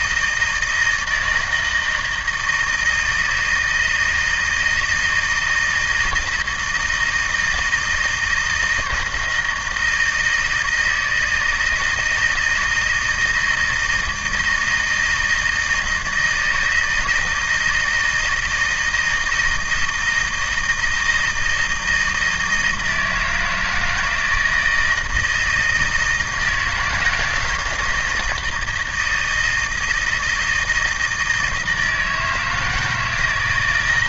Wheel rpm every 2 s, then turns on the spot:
160, 160, 160, 160, 160, 160, 160, 160, 160, 170, 160, 160, 160, 160, 170, 160, 160.
none